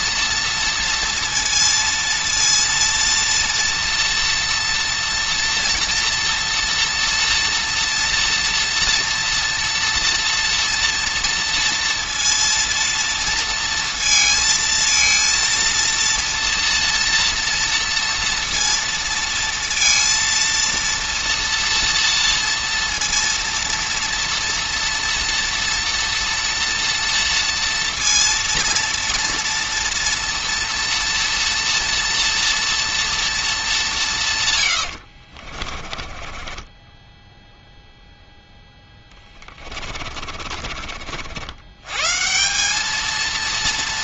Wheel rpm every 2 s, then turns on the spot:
230, 230, 240, 240, 230, 230, 230, 230, 230, 230, 230, 230, 230, 230, 230, 230, 230, 80, 10, 10, 50, 210.
34-40